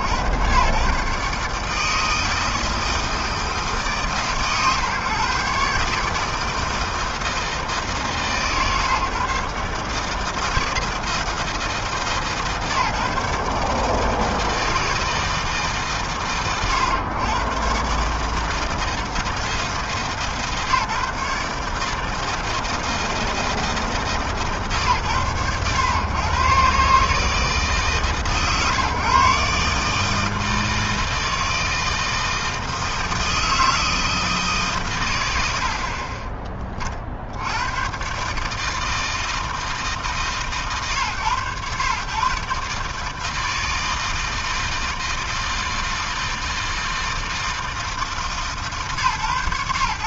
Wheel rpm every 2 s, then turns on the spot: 150, 150, 140, 150, 140, 150, 140, 150, 120, 150, 150, 160, 100, 150, 140, 160, 160, 70, 100, 160, 120, 160, 160, 160, 140.
none